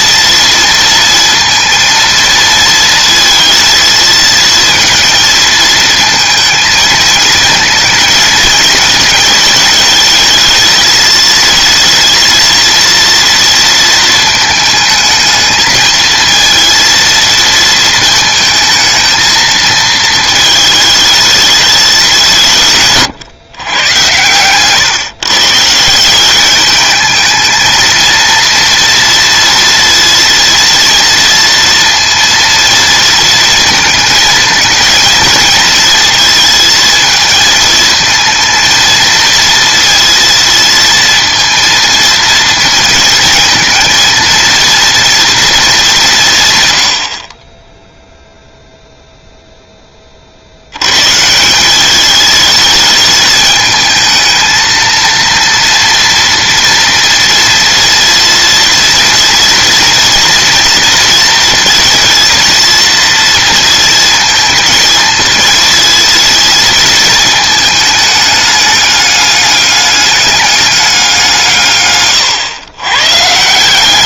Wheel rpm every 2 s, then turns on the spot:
230, 230, 230, 230, 220, 220, 230, 220, 230, 220, 220, 180, 120, 190, 230, 230, 230, 220, 230, 230, 230, 230, 230, 160, 0, 100, 210, 230, 230, 230, 230, 230, 220, 230, 210, 200, 120.
none